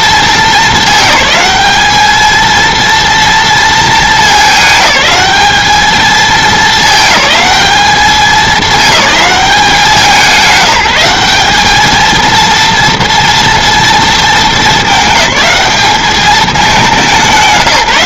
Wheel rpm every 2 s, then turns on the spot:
210, 230, 210, 210, 210, 190, 230, 220, 210.
none